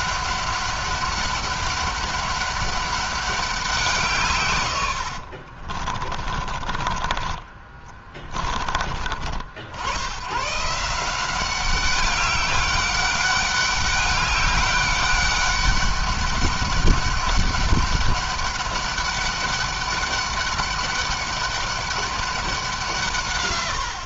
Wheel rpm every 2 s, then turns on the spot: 200, 200, 120, 30, 40, 150, 200, 200, 200, 200, 200, 160.
4-8